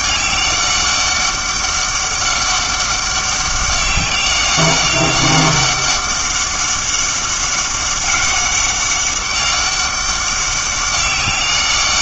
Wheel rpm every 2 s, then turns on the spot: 200, 200, 200, 200, 200, 200.
none